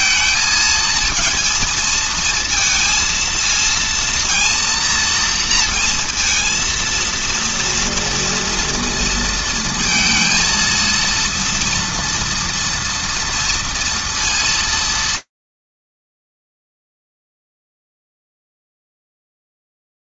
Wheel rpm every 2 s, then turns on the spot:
220, 230, 230, 230, 230, 230, 230, 140, 0, 0.
none